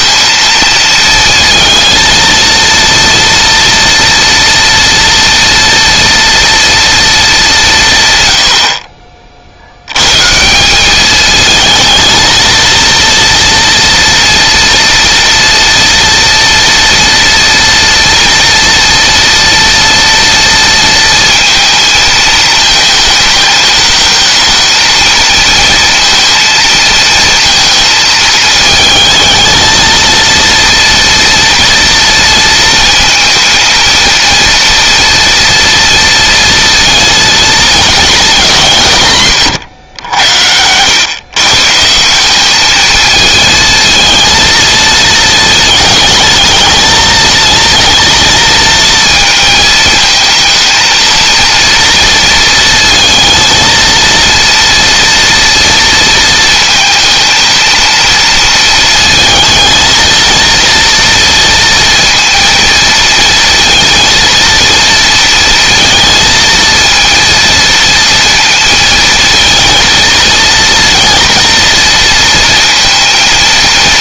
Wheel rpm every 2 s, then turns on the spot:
230, 230, 230, 220, 40, 200, 230, 230, 230, 230, 230, 220, 220, 230, 220, 230, 220, 230, 230, 150, 110, 220, 220, 220, 220, 230, 230, 230, 230, 230, 230, 230, 230, 230, 230, 230, 230.
none